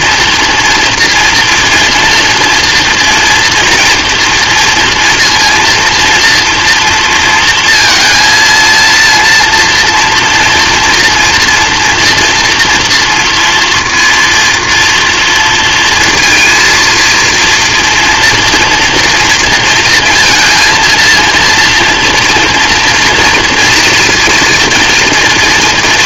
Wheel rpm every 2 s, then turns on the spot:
230, 240, 230, 230, 230, 240, 230, 230, 230, 230, 230, 230, 230.
none